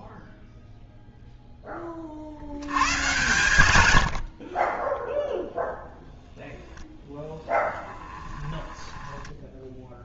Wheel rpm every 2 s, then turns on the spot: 0, 90, 30, 0, 10.
8-10